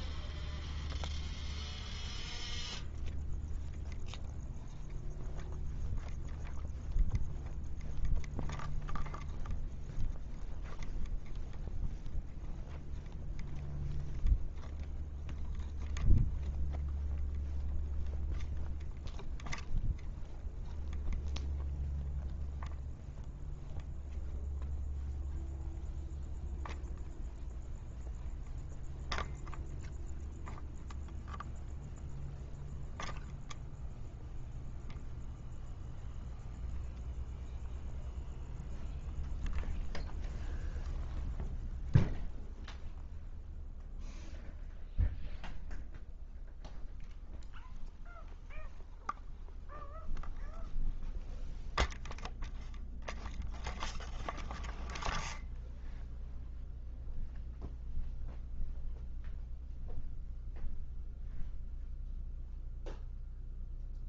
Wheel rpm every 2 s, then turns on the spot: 0, 0, 0, 0, 0, 0, 0, 0, 0, 0, 0, 0, 0, 0, 0, 0, 0, 0, 0, 0, 0, 0, 0, 0, 0, 0, 0, 0, 0, 0, 0, 0.
none